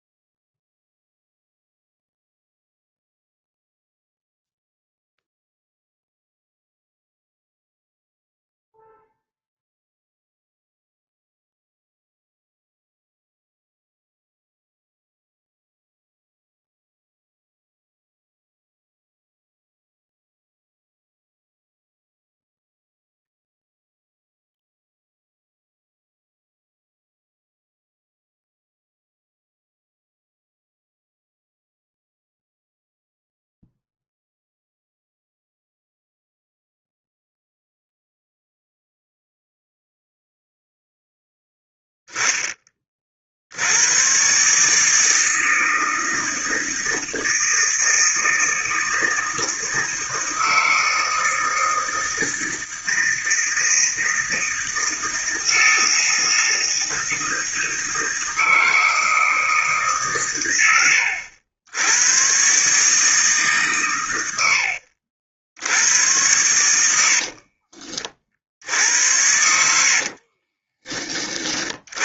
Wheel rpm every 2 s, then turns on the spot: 0, 0, 0, 0, 0, 0, 0, 0, 0, 0, 0, 0, 0, 0, 0, 0, 0, 0, 0, 0, 0, 30, 150, 160, 160, 160, 160, 160, 160, 160, 100, 140, 60, 80, 70, 30.
66-68